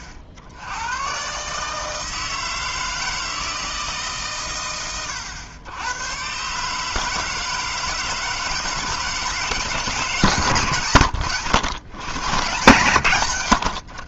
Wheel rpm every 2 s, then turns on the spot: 90, 160, 90, 140, 160, 140, 130.
none